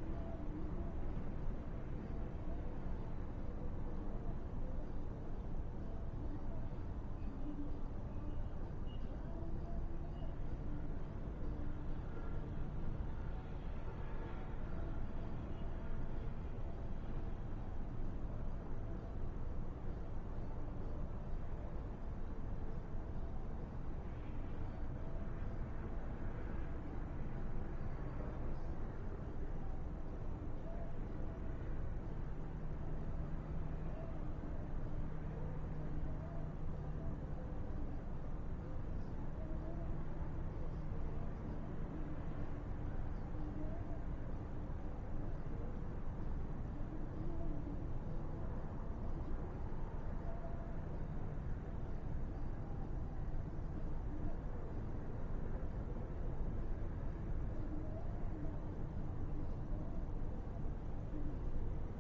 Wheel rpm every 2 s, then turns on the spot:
0, 0, 0, 0, 0, 0, 0, 0, 0, 0, 0, 0, 0, 0, 0, 0, 0, 0, 0, 0, 0, 0, 0, 0, 0, 0, 0, 0, 0, 0, 0.
none